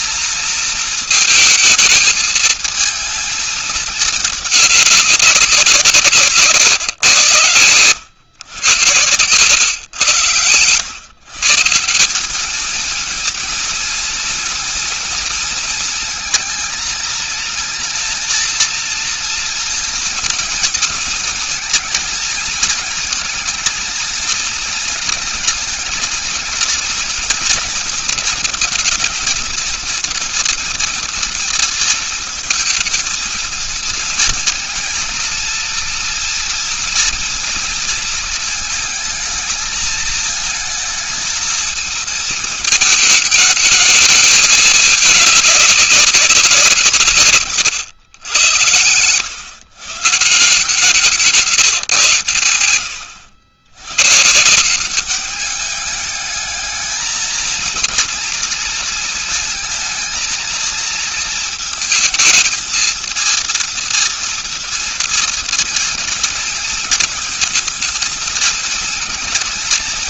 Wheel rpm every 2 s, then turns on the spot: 230, 220, 210, 140, 120, 110, 210, 230, 230, 230, 230, 220, 230, 230, 230, 230, 220, 230, 230, 230, 220, 220, 220, 190, 110, 150, 120, 160, 210, 230, 230, 220, 230, 220, 220.
none